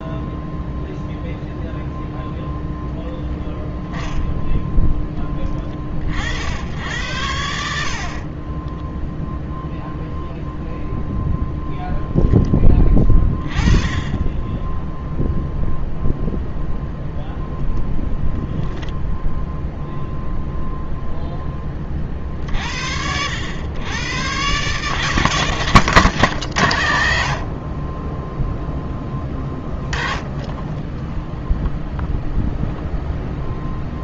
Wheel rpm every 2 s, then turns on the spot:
0, 0, 10, 80, 10, 0, 20, 0, 0, 0, 0, 70, 150, 110, 10, 10, 0.
8-10